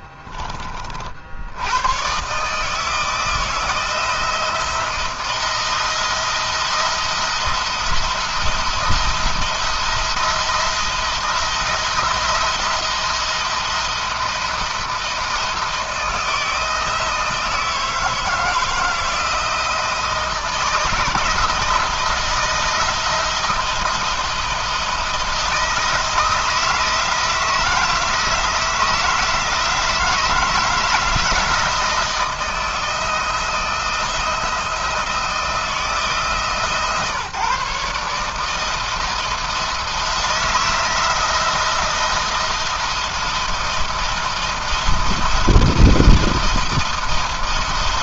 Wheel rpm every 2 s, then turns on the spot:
40, 150, 170, 170, 170, 170, 170, 160, 160, 160, 160, 160, 170, 160, 160, 160, 160, 160, 150, 160, 170, 170, 170, 170.
none